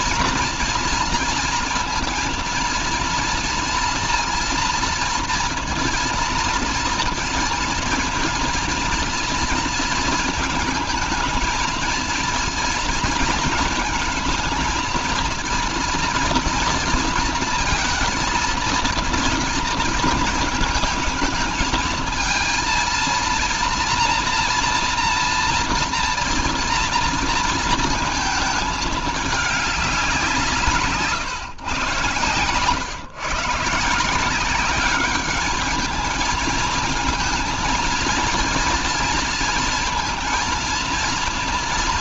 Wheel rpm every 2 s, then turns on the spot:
230, 230, 230, 230, 230, 220, 230, 230, 230, 230, 220, 220, 230, 230, 220, 160, 130, 200, 220, 230, 230.
none